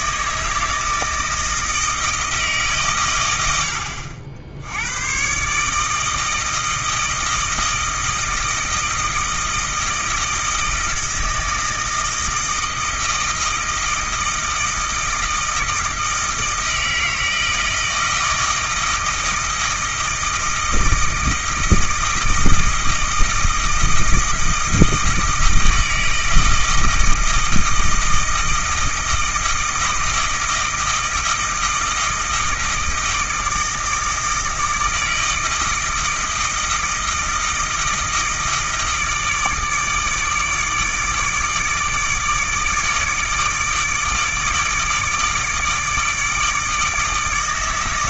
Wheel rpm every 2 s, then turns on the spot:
160, 150, 80, 160, 160, 160, 160, 160, 160, 160, 160, 160, 160, 160, 160, 160, 160, 160, 160, 160, 150, 150, 150, 160.
none